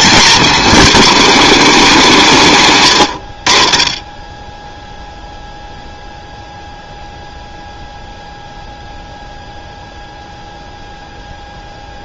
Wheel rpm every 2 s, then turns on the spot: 230, 150, 0, 0, 0, 0.
none